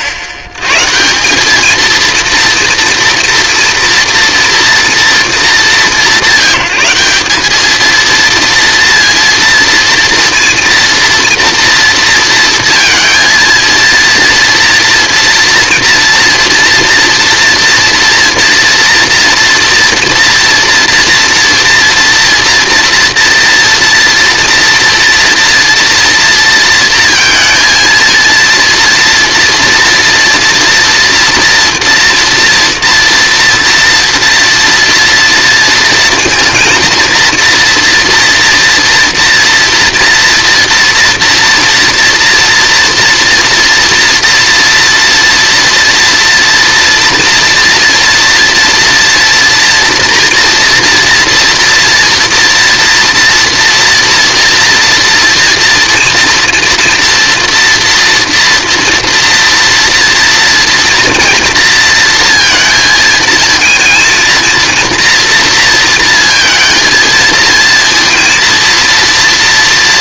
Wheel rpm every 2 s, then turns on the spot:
140, 230, 240, 170, 230, 230, 230, 230, 230, 230, 240, 230, 240, 220, 230, 230, 230, 230, 220, 230, 240, 230, 240, 230, 240, 240, 230, 230, 230, 230, 230, 230, 230, 220, 230.
none